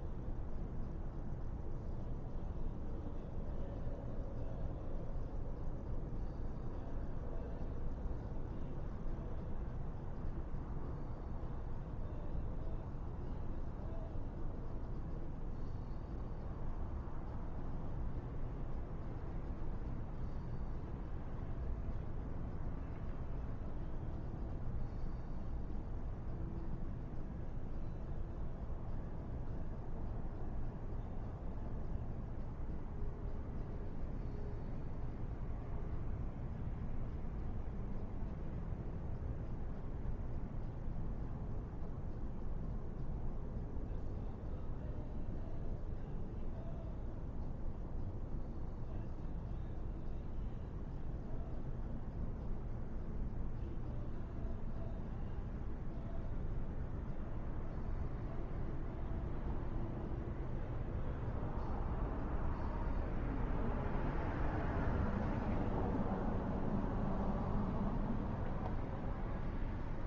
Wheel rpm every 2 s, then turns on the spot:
0, 0, 0, 0, 0, 0, 0, 0, 0, 0, 0, 0, 0, 0, 0, 0, 0, 0, 0, 0, 0, 0, 0, 0, 0, 0, 0, 0, 0, 0, 0, 0, 0, 0, 0.
none